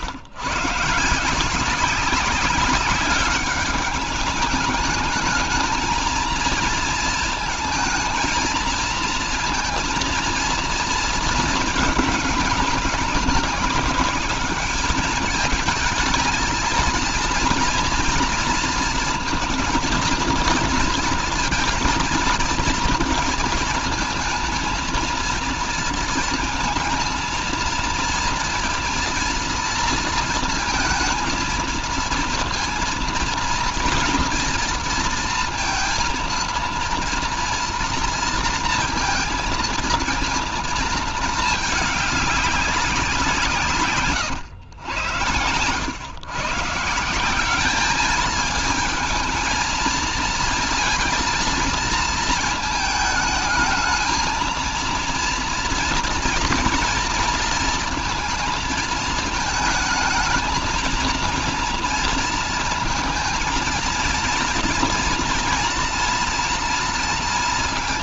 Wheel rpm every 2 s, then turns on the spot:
140, 190, 210, 230, 230, 230, 210, 210, 220, 230, 230, 230, 220, 220, 230, 230, 230, 230, 230, 230, 220, 200, 110, 160, 220, 230, 220, 230, 230, 220, 220, 220, 230, 230.
none